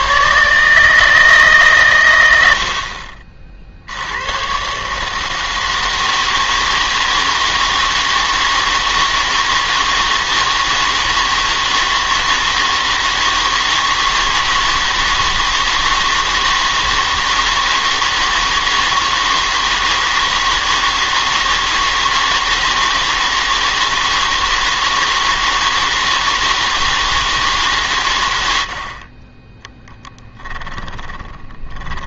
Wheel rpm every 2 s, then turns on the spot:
150, 80, 130, 160, 160, 160, 160, 160, 160, 160, 160, 160, 160, 160, 70, 20.
30-32